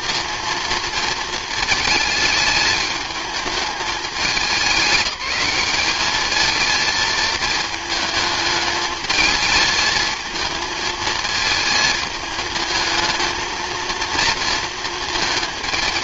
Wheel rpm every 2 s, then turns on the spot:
230, 220, 190, 220, 220, 220, 220, 230.
none